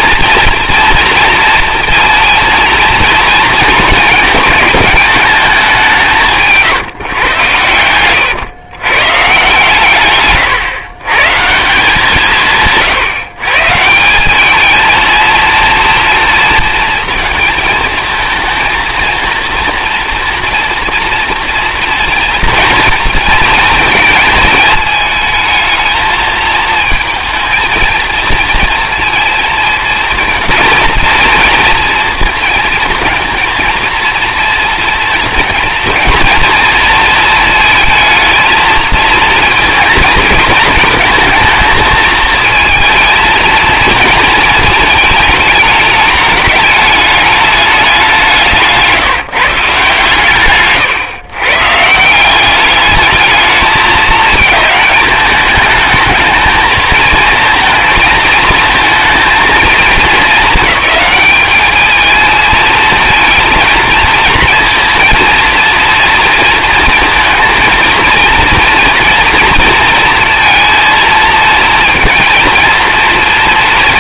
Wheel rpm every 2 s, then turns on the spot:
230, 230, 210, 160, 120, 130, 150, 220, 230, 230, 230, 230, 220, 220, 230, 230, 220, 230, 230, 220, 220, 220, 220, 210, 170, 130, 210, 220, 220, 220, 220, 220, 230, 230, 230, 230, 230.
48-52